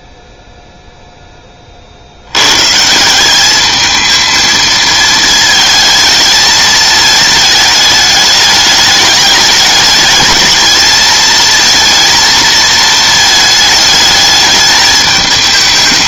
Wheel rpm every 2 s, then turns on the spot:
0, 130, 220, 220, 210, 220, 220, 210.
none